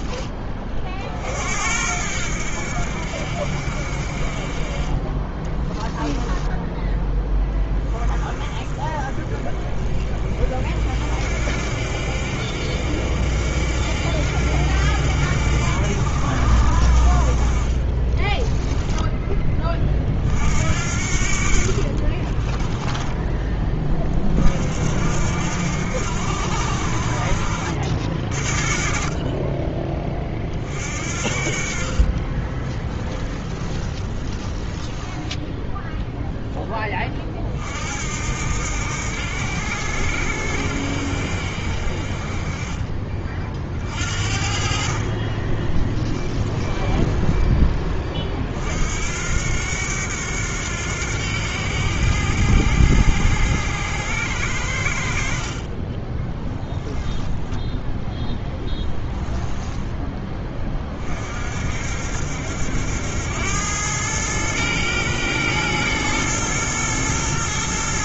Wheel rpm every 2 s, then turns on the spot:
40, 70, 30, 10, 30, 40, 70, 70, 60, 10, 60, 20, 60, 70, 40, 40, 30, 20, 10, 80, 70, 30, 40, 10, 50, 90, 90, 70, 10, 10, 30, 80, 110, 110.
6-8 18-20 22-24 32-36 42-44 46-48 56-60